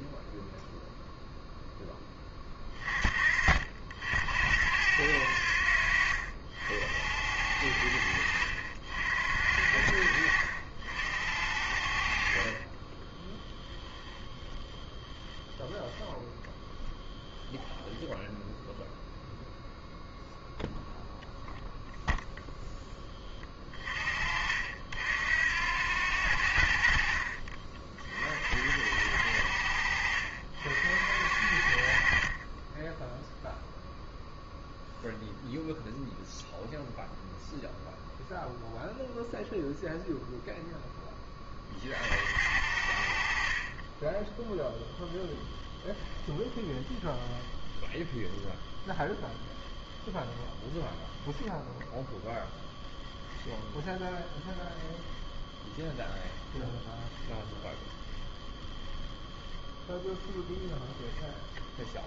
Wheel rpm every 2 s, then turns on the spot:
0, 40, 80, 70, 60, 60, 10, 10, 0, 0, 0, 20, 70, 60, 80, 60, 0, 0, 0, 0, 20, 50, 10, 10, 10, 0, 10, 10, 20, 10, 10.
12-16 26-28 44-48 54-58 60-62